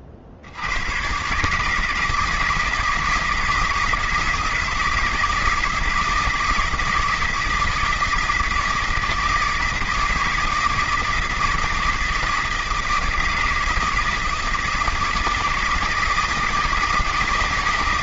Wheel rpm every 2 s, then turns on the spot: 90, 160, 170, 160, 160, 160, 160, 160, 160.
none